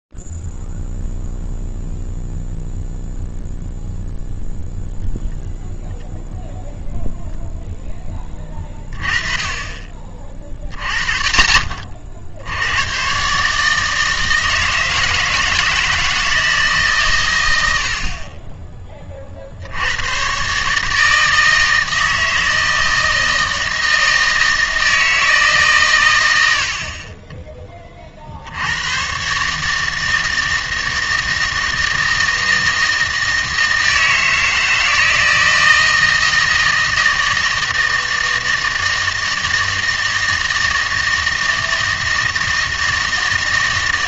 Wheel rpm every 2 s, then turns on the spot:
0, 0, 0, 0, 20, 40, 80, 160, 160, 40, 140, 160, 160, 70, 90, 160, 160, 160, 160, 160, 160, 160.
none